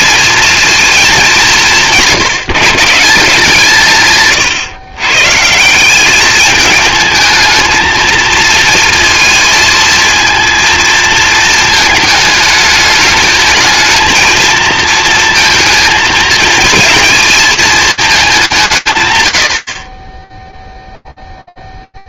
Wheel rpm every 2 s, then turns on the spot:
230, 170, 150, 210, 230, 230, 220, 230, 230, 170, 0.
none